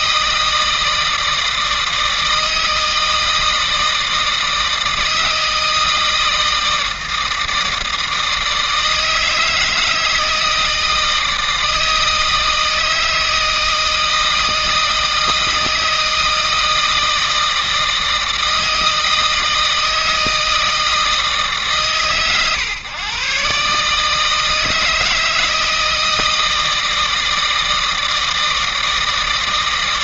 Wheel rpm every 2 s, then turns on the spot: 160, 160, 160, 160, 160, 160, 160, 160, 160, 160, 160, 130, 160, 160, 160.
none